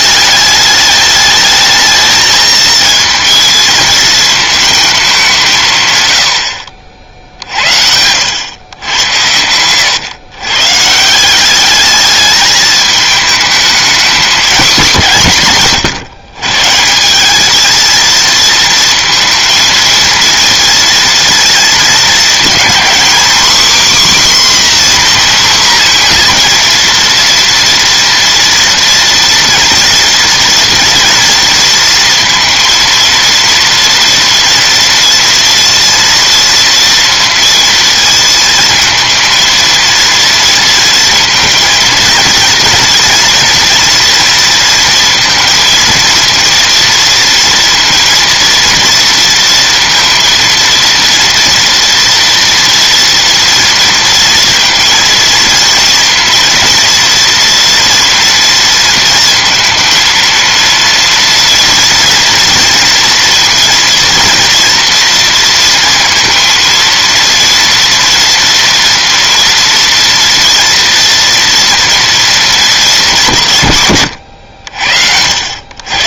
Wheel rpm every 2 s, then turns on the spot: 210, 220, 220, 70, 100, 120, 210, 220, 130, 230, 230, 230, 270, 240, 230, 230, 230, 230, 240, 220, 230, 230, 230, 230, 230, 230, 230, 230, 240, 230, 230, 230, 230, 230, 230, 230, 220, 80.
none